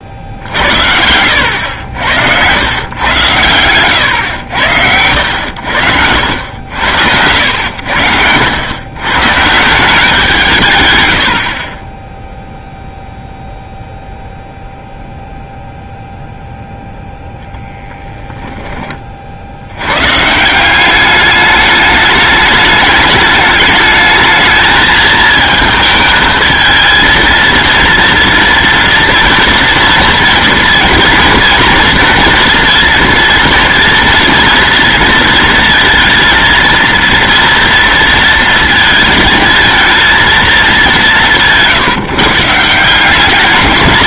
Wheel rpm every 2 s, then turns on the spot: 70, 110, 100, 90, 100, 130, 0, 0, 0, 10, 170, 210, 220, 220, 230, 230, 230, 230, 230, 230, 210, 160.
none